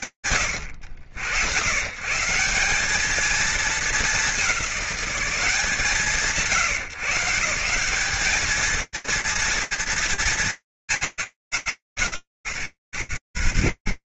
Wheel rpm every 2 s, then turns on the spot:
90, 210, 190, 140, 230, 170, 110.
none